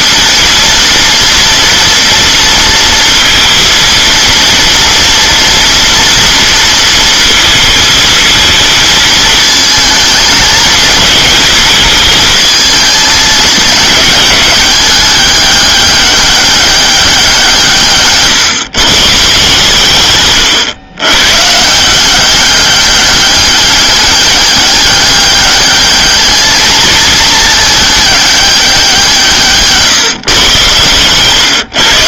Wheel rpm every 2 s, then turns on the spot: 240, 230, 230, 230, 230, 220, 220, 210, 200, 150, 110, 200, 200, 220, 200, 130.
none